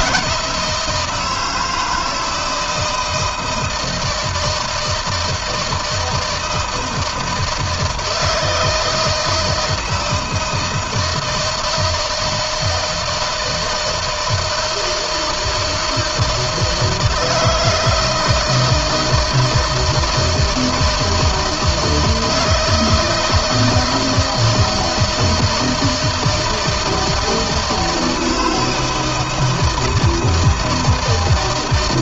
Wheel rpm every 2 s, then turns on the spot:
170, 160, 160, 160, 160, 160, 160, 160, 160, 160, 160, 160, 160, 160, 160, 160.
none